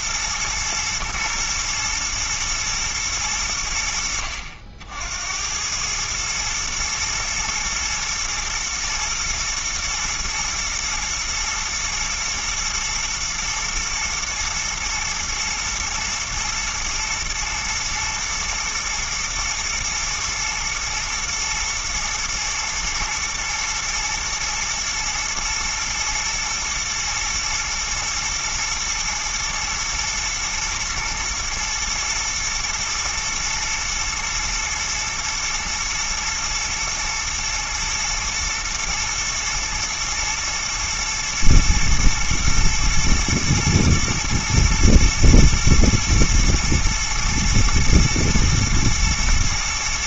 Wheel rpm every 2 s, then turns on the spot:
120, 110, 70, 110, 110, 120, 120, 110, 120, 110, 110, 110, 110, 110, 110, 110, 110, 110, 110, 110, 110, 120, 120, 120, 120.
none